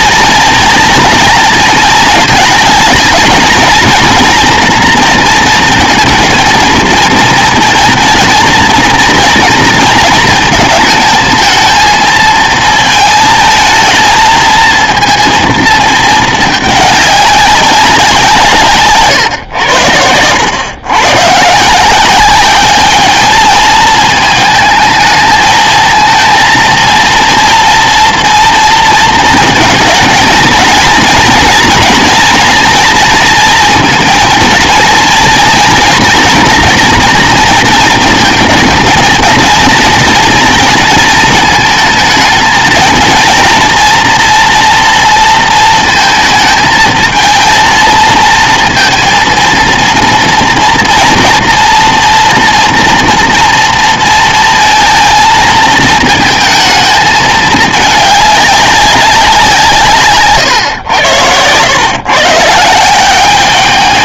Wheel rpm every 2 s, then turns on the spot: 230, 220, 240, 220, 230, 220, 220, 230, 210, 140, 120, 210, 220, 230, 230, 220, 230, 230, 230, 230, 230, 230, 230, 220, 230, 240, 230, 230, 220, 200, 100, 170.
none